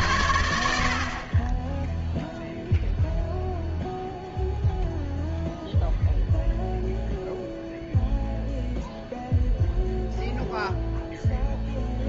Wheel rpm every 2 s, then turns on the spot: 70, 0, 0, 0, 0, 0.
none